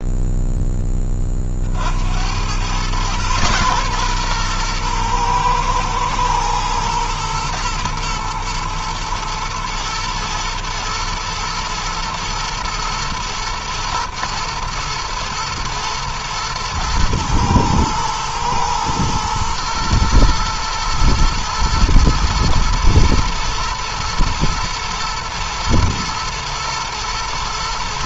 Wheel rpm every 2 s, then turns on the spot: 20, 120, 120, 120, 110, 110, 110, 120, 120, 110, 110, 120, 120, 120.
none